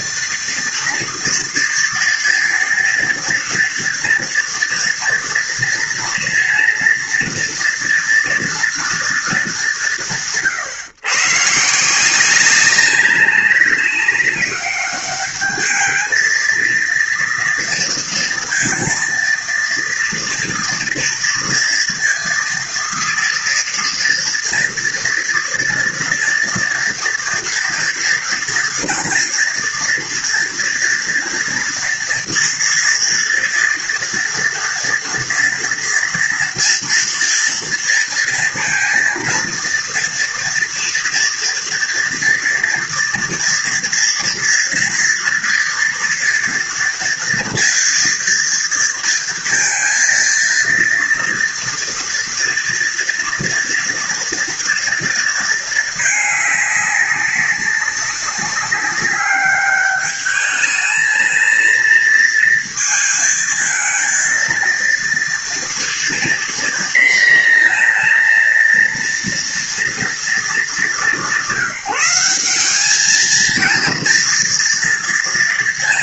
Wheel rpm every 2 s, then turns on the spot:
240, 230, 230, 230, 230, 130, 190, 200, 230, 230, 230, 230, 230, 230, 230, 230, 230, 230, 230, 230, 230, 230, 230, 240, 230, 230, 230, 230, 200, 190, 210, 230, 230, 240, 230, 210, 210, 240.
none